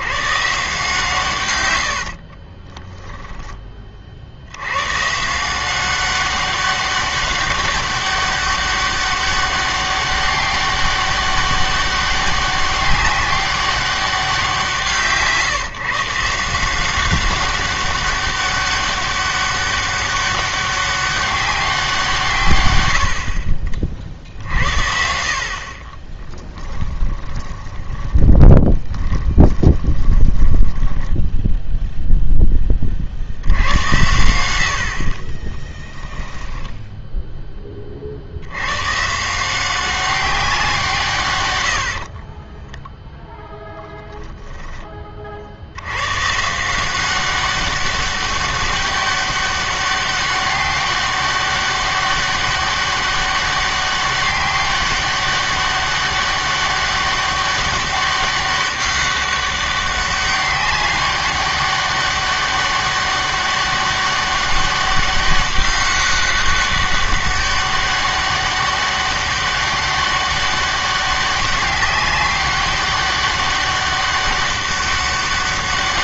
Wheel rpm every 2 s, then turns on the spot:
120, 40, 70, 190, 200, 200, 190, 190, 160, 200, 200, 140, 60, 10, 20, 10, 10, 90, 10, 80, 190, 20, 20, 140, 200, 200, 200, 200, 200, 200, 200, 200, 200, 200, 200, 200, 200, 200.
2-4 26-32 36-38 42-46